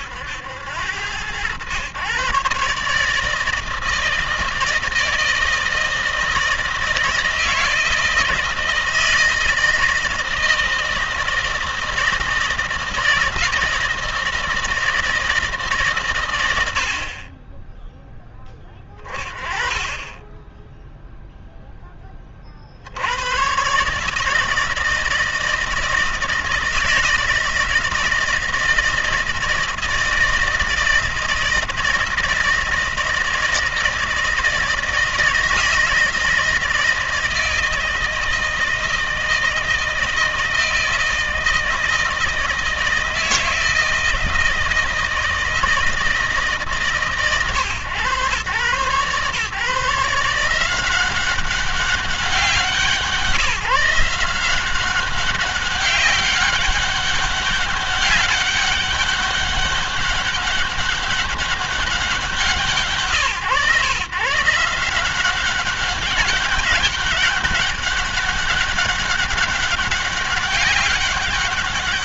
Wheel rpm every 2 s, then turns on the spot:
90, 140, 160, 160, 160, 160, 160, 160, 90, 10, 0, 60, 160, 160, 160, 160, 160, 160, 160, 160, 160, 160, 160, 150, 110, 180, 170, 180, 200, 200, 200, 150, 170, 200, 200, 200.
none